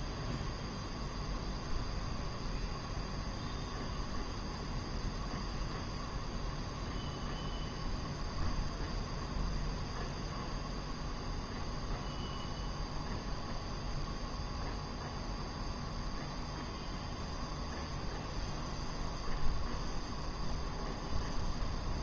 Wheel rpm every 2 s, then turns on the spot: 0, 0, 0, 0, 0, 0, 0, 0, 0, 0, 0.
none